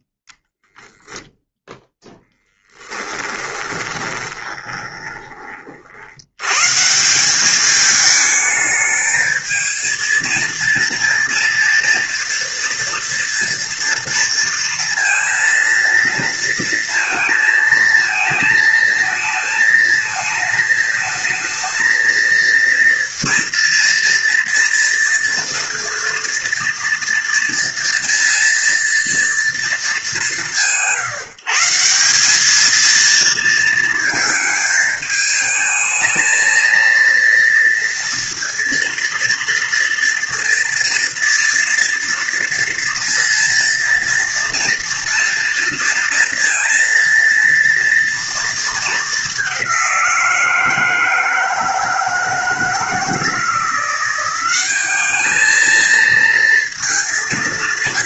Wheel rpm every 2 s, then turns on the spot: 0, 20, 30, 200, 220, 230, 230, 230, 220, 220, 220, 230, 230, 230, 200, 160, 230, 220, 230, 230, 230, 230, 230, 230, 200, 160, 170, 210, 180.
2-4